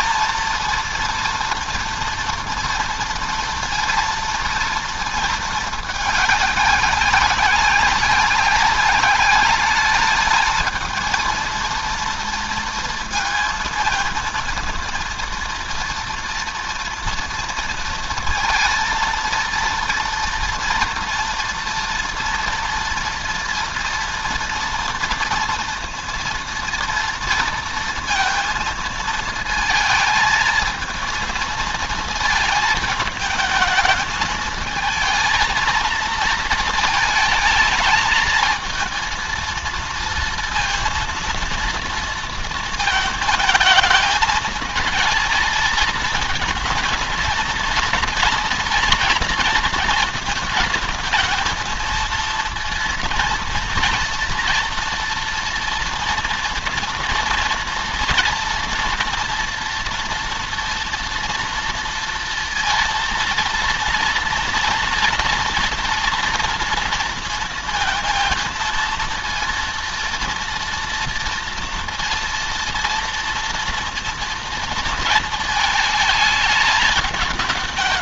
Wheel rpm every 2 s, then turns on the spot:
230, 230, 230, 200, 200, 220, 230, 230, 230, 230, 230, 230, 240, 230, 230, 220, 220, 220, 220, 220, 230, 230, 220, 230, 230, 230, 230, 230, 230, 230, 230, 230, 230, 230, 230, 230, 230, 230, 210.
none